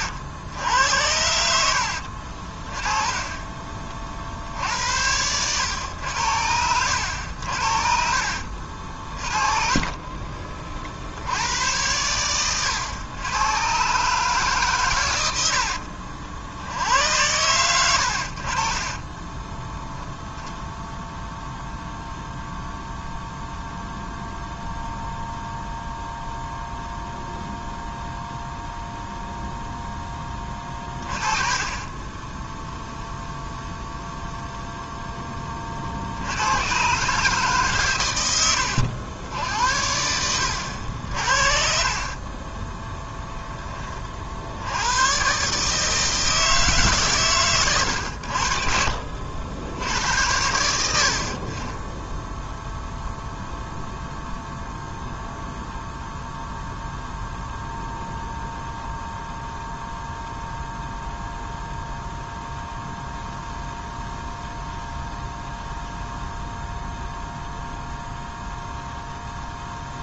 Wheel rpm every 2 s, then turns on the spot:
80, 20, 70, 80, 40, 60, 100, 120, 80, 30, 0, 0, 0, 0, 0, 30, 0, 0, 130, 80, 70, 10, 100, 140, 60, 80, 0, 0, 0, 0, 0, 0, 0, 0, 0.
4-6 8-10 18-20 42-44